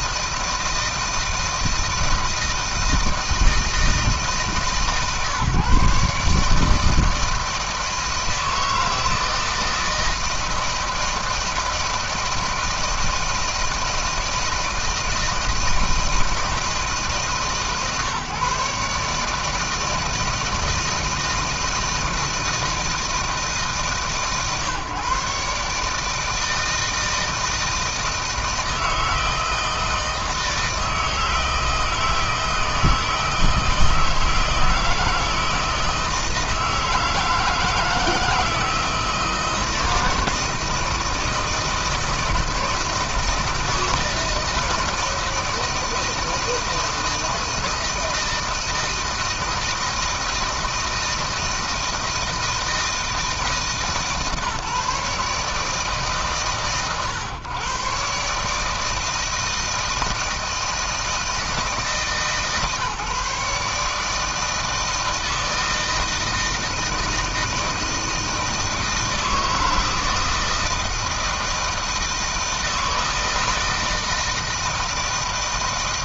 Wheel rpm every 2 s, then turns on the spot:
160, 160, 150, 160, 160, 160, 160, 160, 150, 140, 160, 160, 140, 160, 160, 160, 160, 160, 160, 160, 160, 160, 160, 160, 160, 160, 160, 150, 130, 150, 160, 140, 160, 160, 160, 160, 160, 160.
none